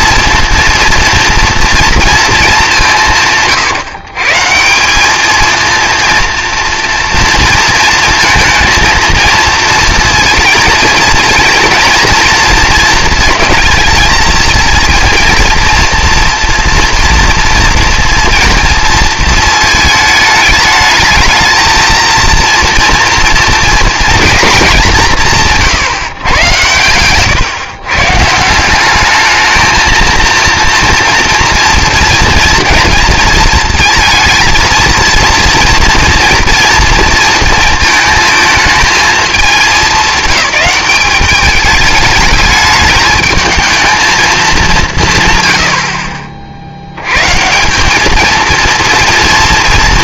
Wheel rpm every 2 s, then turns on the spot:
230, 200, 170, 230, 230, 230, 230, 230, 230, 230, 210, 230, 200, 120, 180, 230, 230, 230, 230, 220, 200, 210, 200, 70, 230.
26-28